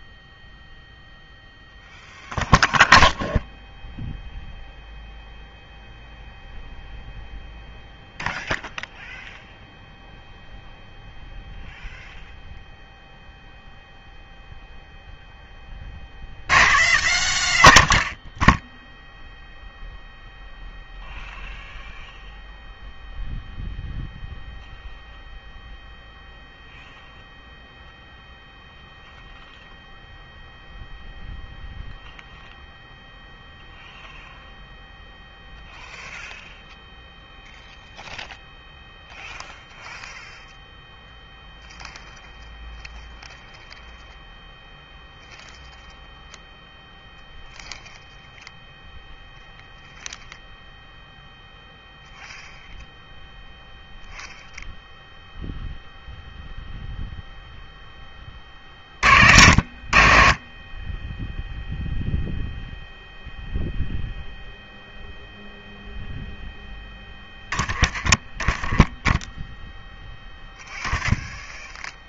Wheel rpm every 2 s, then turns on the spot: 0, 0, 0, 0, 0, 0, 0, 0, 110, 10, 0, 0, 0, 0, 0, 0, 0, 0, 0, 0, 0, 0, 0, 0, 0, 0, 0, 0, 0, 40, 20, 0, 0, 10, 20, 10.
none